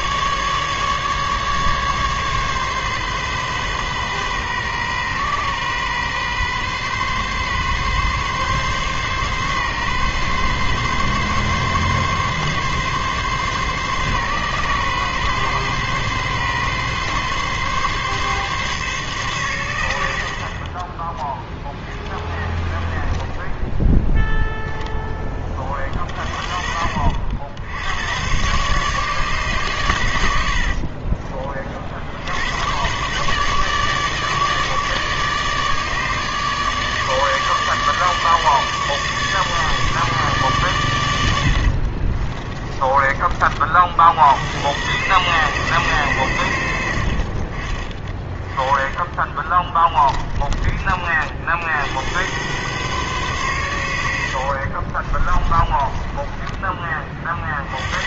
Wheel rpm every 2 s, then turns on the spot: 150, 140, 130, 130, 140, 140, 140, 130, 140, 140, 30, 20, 0, 40, 140, 60, 110, 150, 150, 150, 130, 20, 90, 90, 30, 20, 120, 50, 20.
30-32 42-44 54-56